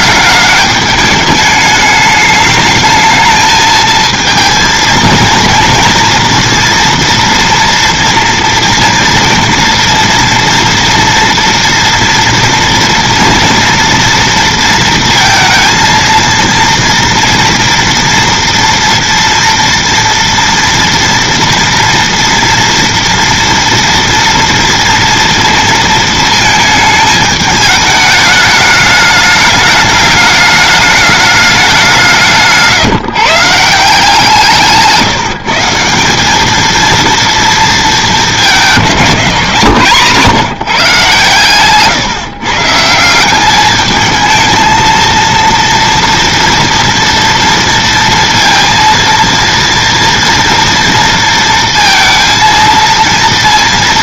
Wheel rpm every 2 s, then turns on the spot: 210, 210, 230, 230, 230, 240, 230, 230, 230, 230, 230, 240, 230, 220, 210, 210, 150, 160, 220, 200, 150, 150, 220, 230, 230, 230, 230.
none